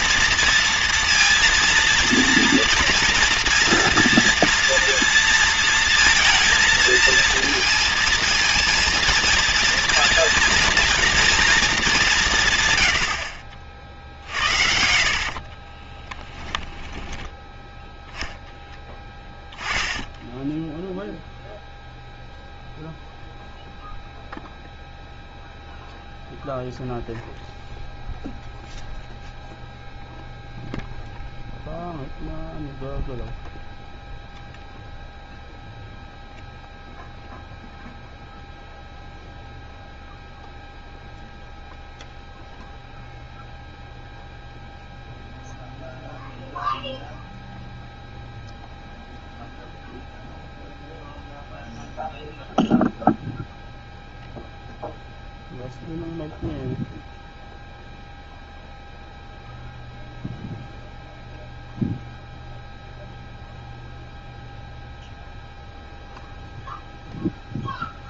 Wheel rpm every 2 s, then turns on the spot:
230, 230, 230, 230, 230, 230, 120, 60, 10, 10, 0, 0, 0, 0, 0, 0, 0, 0, 0, 0, 0, 0, 0, 0, 0, 0, 0, 0, 0, 0, 0, 0, 0, 0.
14-20